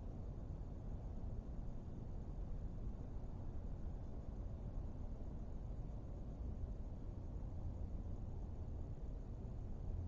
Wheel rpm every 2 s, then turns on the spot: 0, 0, 0, 0, 0.
none